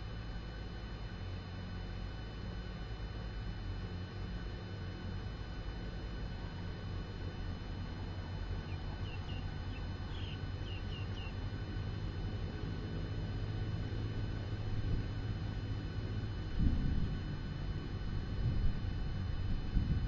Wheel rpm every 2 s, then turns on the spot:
0, 0, 0, 0, 0, 0, 0, 0, 0, 0.
none